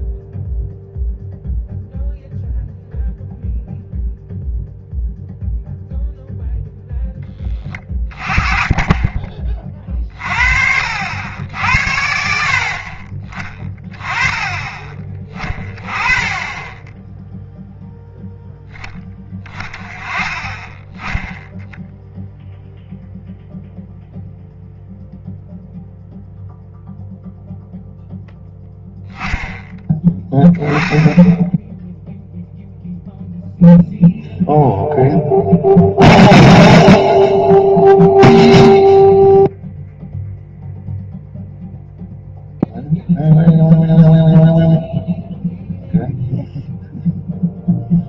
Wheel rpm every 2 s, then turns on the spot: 0, 0, 0, 0, 20, 60, 50, 20, 10, 10, 10, 0, 0, 0, 0, 0, 0, 0, 0, 0, 0, 0, 0, 0.
none